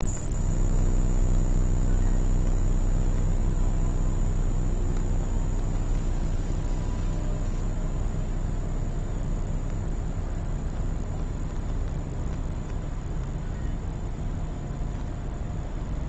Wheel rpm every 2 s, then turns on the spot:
0, 0, 0, 0, 0, 0, 0, 0.
none